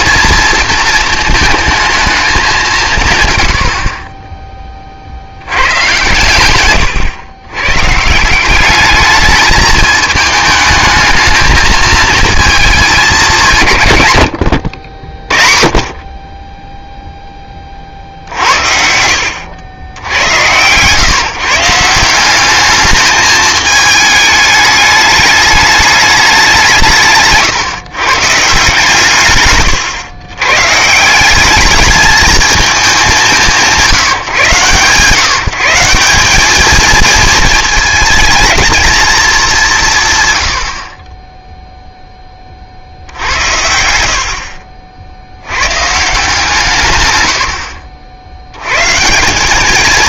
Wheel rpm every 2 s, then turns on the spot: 230, 180, 20, 120, 210, 220, 210, 60, 10, 70, 120, 210, 210, 170, 150, 140, 210, 140, 220, 230, 60, 40, 60, 130, 120.
none